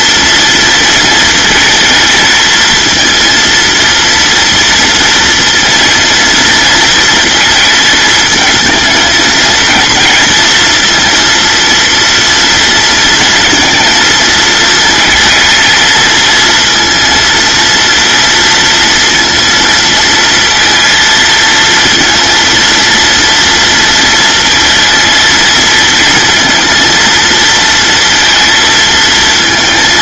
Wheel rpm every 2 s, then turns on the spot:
230, 230, 230, 230, 220, 230, 230, 230, 230, 230, 230, 230, 230, 230, 230.
none